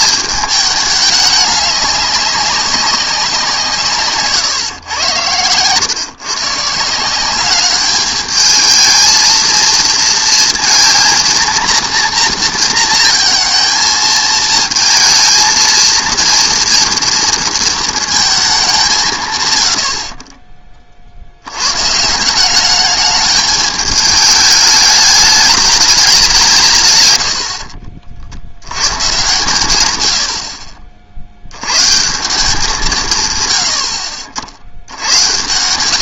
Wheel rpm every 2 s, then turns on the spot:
210, 200, 130, 140, 220, 230, 230, 220, 230, 190, 30, 200, 210, 150, 90, 60, 180, 60.
none